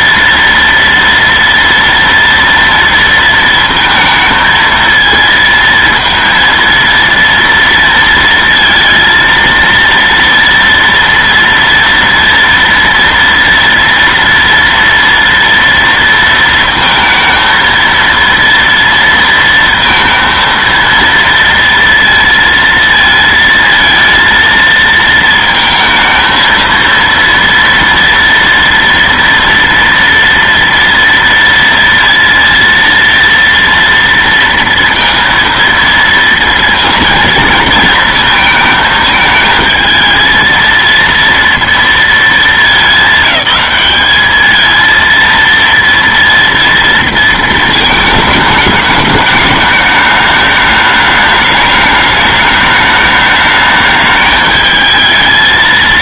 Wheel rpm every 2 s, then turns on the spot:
230, 240, 220, 230, 230, 230, 230, 230, 230, 230, 230, 230, 230, 220, 230, 230, 230, 230, 230, 230, 220, 220, 210, 230, 220, 210, 210, 210.
none